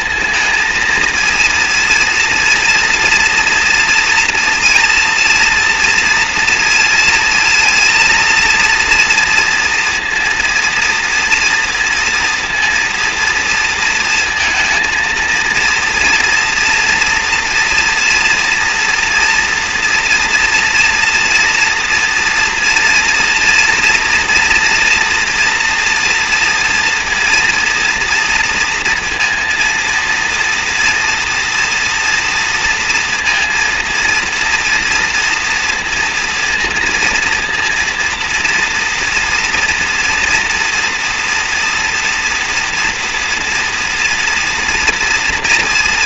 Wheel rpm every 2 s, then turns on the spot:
230, 230, 230, 230, 230, 230, 230, 230, 230, 230, 240, 240, 240, 230, 230, 230, 230, 230, 230, 230, 240, 230, 230.
none